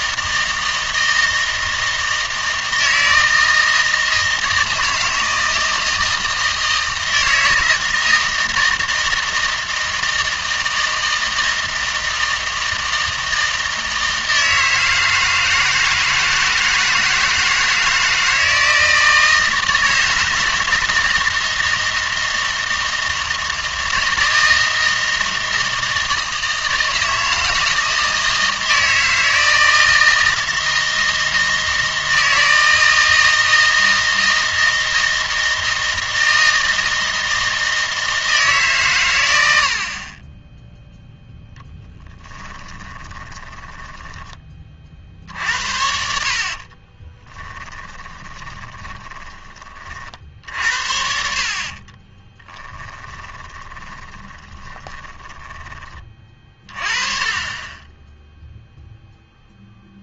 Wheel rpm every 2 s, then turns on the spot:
160, 160, 160, 160, 160, 160, 160, 160, 160, 160, 160, 160, 160, 160, 160, 160, 160, 160, 160, 140, 0, 20, 30, 40, 20, 60, 10, 30, 30, 0.
42-44 46-50 52-56